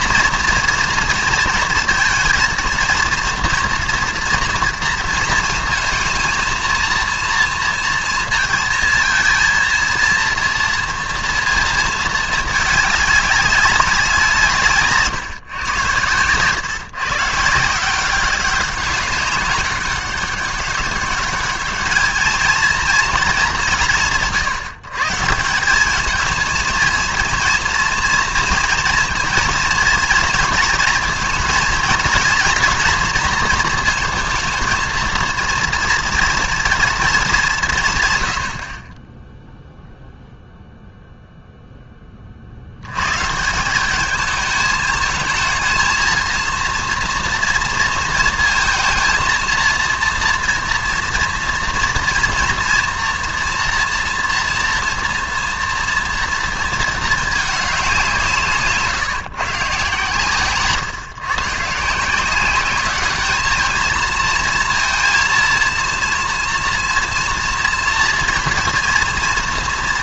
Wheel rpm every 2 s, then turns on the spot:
230, 230, 230, 220, 230, 230, 210, 140, 130, 190, 200, 230, 150, 230, 230, 230, 230, 220, 230, 50, 0, 80, 220, 230, 230, 240, 230, 240, 230, 160, 130, 200, 230, 230, 230.
none